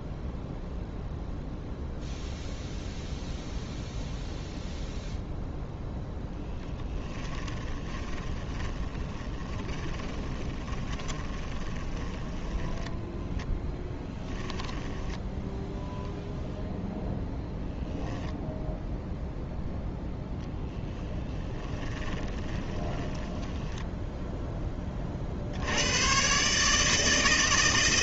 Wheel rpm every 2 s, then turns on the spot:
0, 0, 0, 10, 30, 20, 10, 10, 0, 0, 10, 20, 10, 140.
6-16 22-24